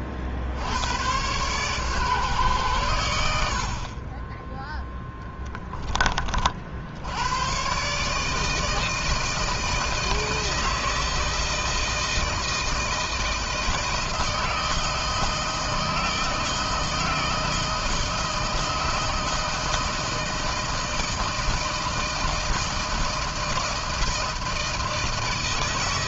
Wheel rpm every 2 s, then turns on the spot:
60, 130, 10, 40, 150, 160, 160, 160, 160, 160, 160, 160, 160.
none